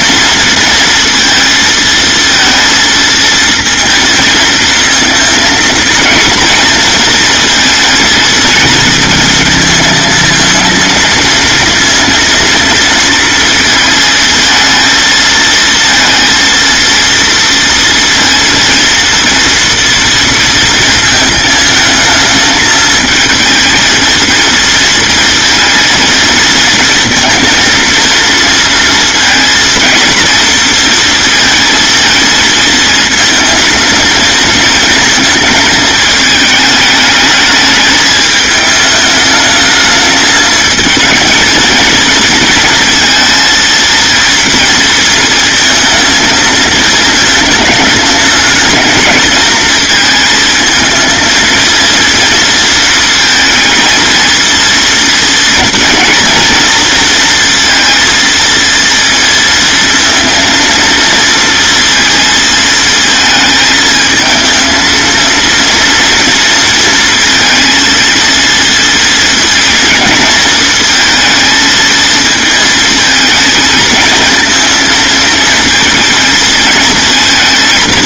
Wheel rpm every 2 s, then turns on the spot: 230, 230, 230, 230, 230, 230, 230, 220, 230, 230, 230, 220, 230, 230, 230, 230, 230, 220, 220, 210, 220, 230, 230, 220, 230, 220, 230, 230, 230, 230, 230, 220, 230, 230, 230, 230, 220, 230, 230.
none